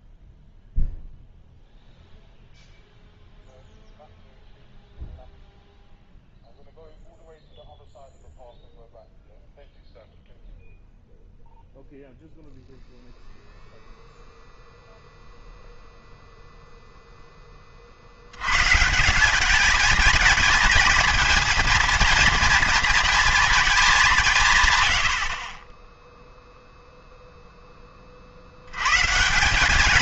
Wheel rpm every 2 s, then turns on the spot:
0, 0, 0, 0, 0, 0, 0, 0, 0, 120, 220, 230, 120, 0, 90.
none